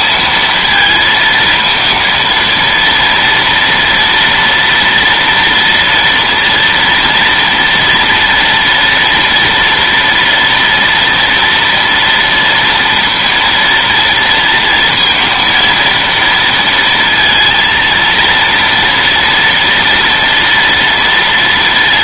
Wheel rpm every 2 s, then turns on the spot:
220, 230, 230, 230, 230, 230, 230, 230, 230, 230, 230.
none